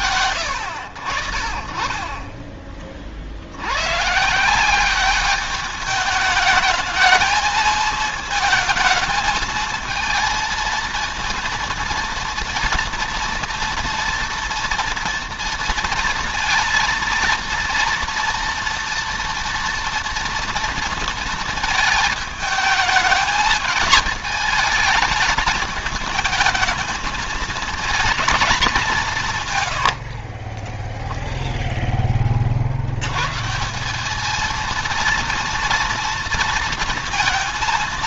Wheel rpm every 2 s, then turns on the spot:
70, 50, 200, 220, 220, 230, 240, 240, 230, 230, 220, 220, 220, 220, 180, 0, 110, 230, 230.
none